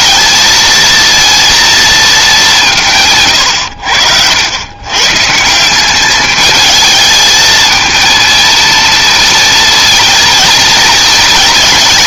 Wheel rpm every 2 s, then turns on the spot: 220, 180, 100, 220, 230, 230.
none